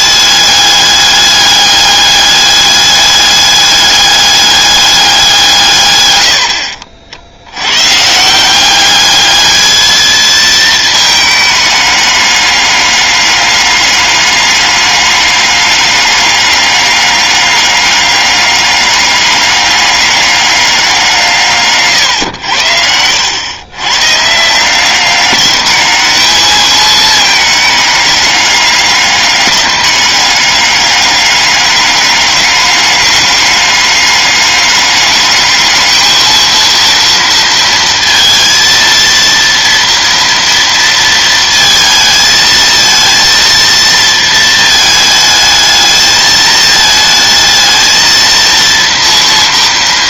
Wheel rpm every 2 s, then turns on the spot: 200, 210, 200, 60, 200, 220, 200, 200, 200, 200, 180, 90, 180, 210, 200, 200, 210, 210, 230, 230, 230, 230, 220, 220, 230.
none